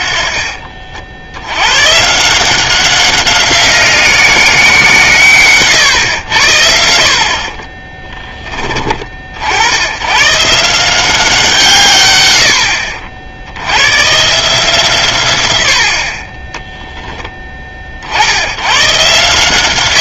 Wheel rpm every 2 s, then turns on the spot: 50, 180, 170, 70, 30, 160, 80, 150, 20, 100.
16-18